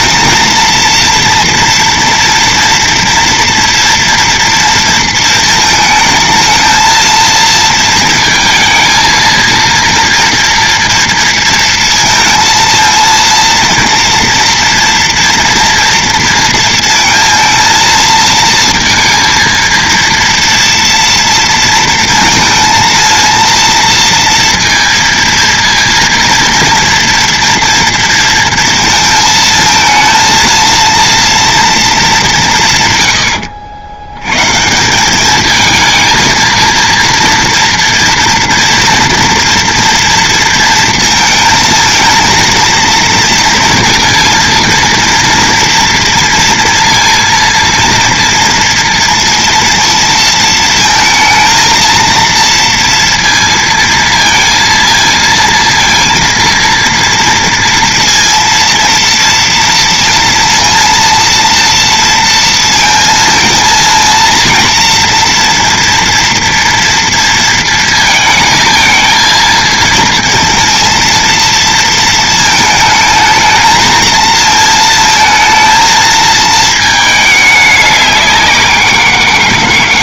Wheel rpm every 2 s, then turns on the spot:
230, 230, 230, 220, 230, 230, 230, 230, 230, 230, 230, 220, 230, 230, 230, 230, 160, 140, 230, 230, 230, 230, 230, 230, 230, 230, 230, 230, 230, 230, 230, 230, 230, 230, 220, 230, 220, 220, 220, 190.
none